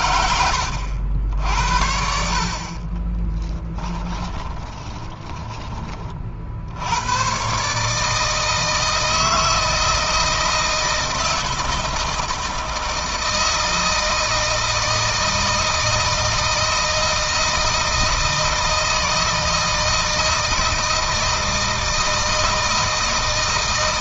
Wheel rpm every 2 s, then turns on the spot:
80, 40, 20, 80, 160, 160, 160, 160, 160, 160, 160, 160.
2-6